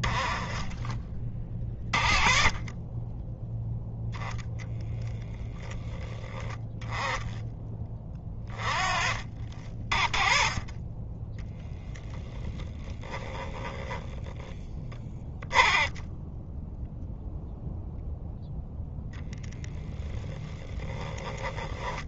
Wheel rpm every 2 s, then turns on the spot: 30, 20, 10, 20, 30, 30, 10, 10, 0, 10, 20.
10-16 18-22